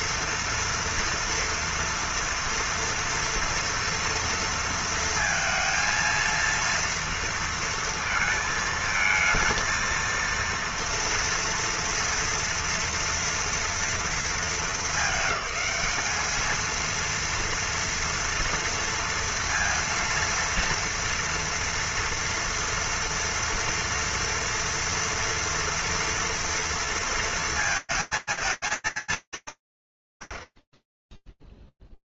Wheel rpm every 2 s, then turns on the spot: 230, 240, 230, 230, 220, 230, 230, 210, 230, 230, 230, 230, 230, 230, 230, 30.
none